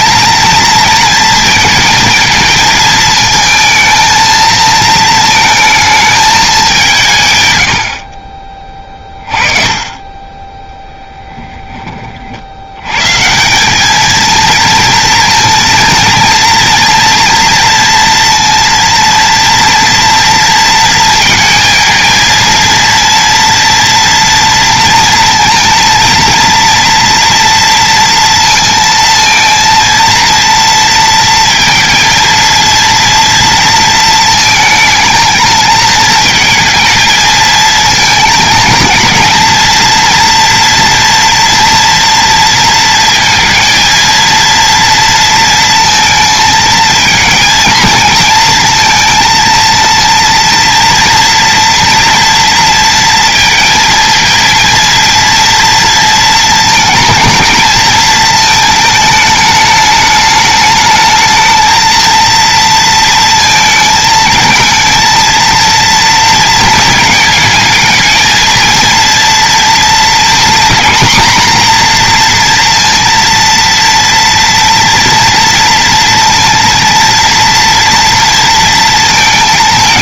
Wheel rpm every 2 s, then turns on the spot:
230, 220, 220, 180, 20, 10, 110, 230, 230, 230, 230, 230, 230, 230, 230, 230, 230, 220, 220, 230, 230, 230, 230, 230, 230, 230, 230, 230, 220, 220, 210, 230, 230, 230, 230, 230, 230, 230, 230, 230.
10-12